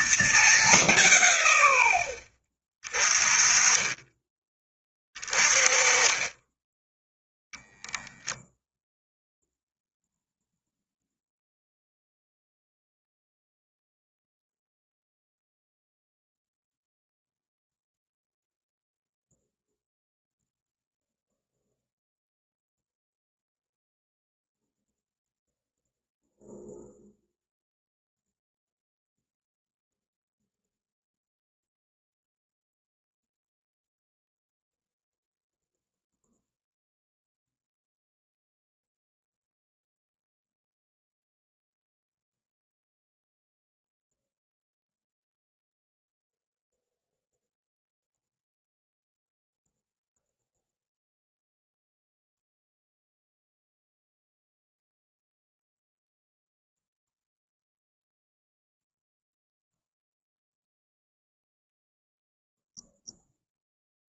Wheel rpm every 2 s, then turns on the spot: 190, 30, 20, 10, 0, 0, 0, 0, 0, 0, 0, 0, 0, 0, 0, 0, 0, 0, 0, 0, 0, 0, 0, 0, 0, 0, 0, 0, 0, 0, 0, 0.
none